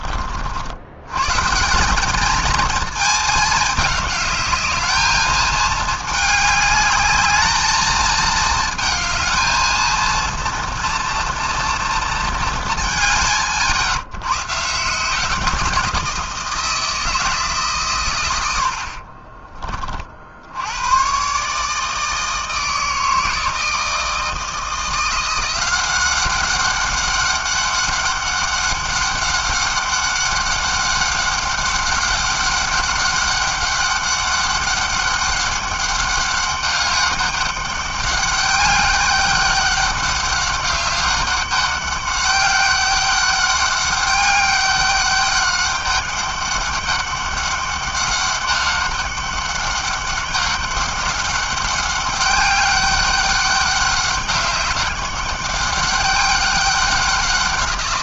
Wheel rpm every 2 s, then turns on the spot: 80, 220, 210, 210, 220, 230, 200, 150, 170, 70, 90, 160, 170, 200, 200, 200, 200, 200, 200, 200, 200, 200, 200, 200, 200, 200, 200, 200, 190.
18-20